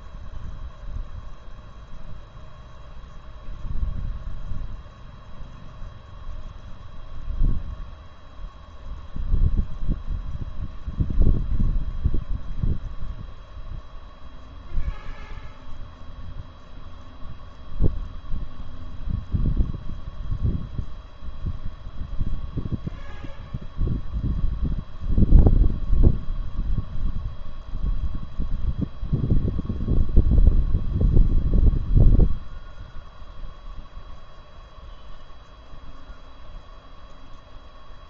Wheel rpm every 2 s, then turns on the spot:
0, 0, 0, 0, 0, 0, 0, 0, 0, 0, 0, 0, 0, 0, 0, 0, 0, 0, 0.
none